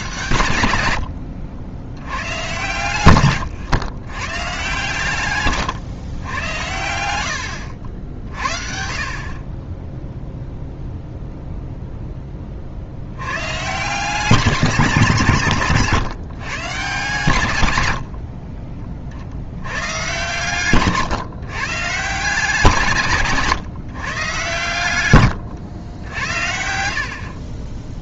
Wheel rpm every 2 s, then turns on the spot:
90, 120, 130, 80, 50, 0, 60, 190, 130, 30, 130, 160, 120, 60.
2-4 20-22 26-28